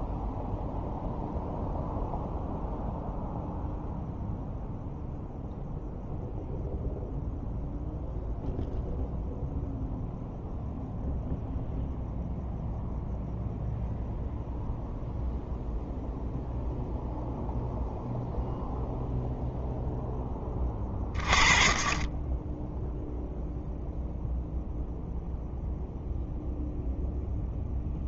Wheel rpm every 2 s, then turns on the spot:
0, 0, 0, 0, 0, 0, 0, 0, 0, 0, 20, 0, 0, 0.
none